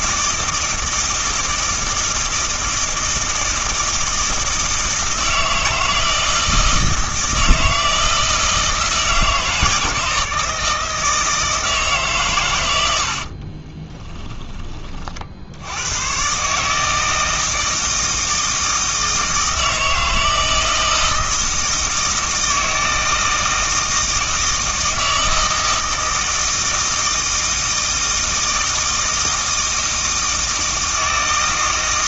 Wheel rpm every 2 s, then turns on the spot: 160, 160, 160, 160, 160, 160, 70, 40, 160, 160, 160, 160, 160, 160, 160, 160.
none